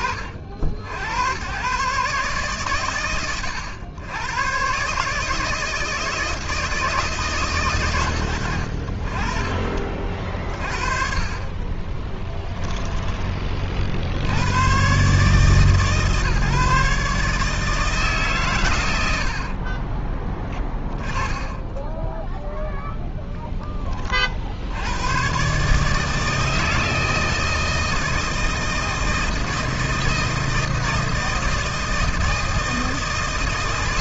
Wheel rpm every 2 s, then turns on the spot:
70, 80, 140, 160, 70, 40, 10, 130, 140, 90, 10, 0, 110, 160, 160, 160, 160.
none